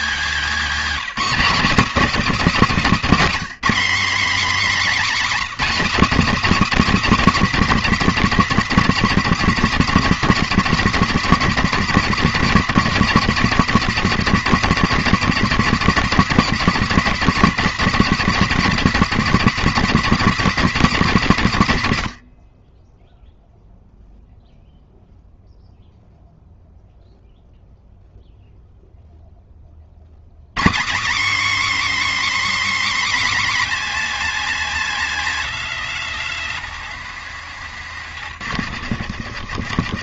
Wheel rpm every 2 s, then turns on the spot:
260, 250, 280, 250, 240, 240, 240, 240, 230, 250, 210, 0, 0, 0, 0, 270, 280, 230, 150, 120.
none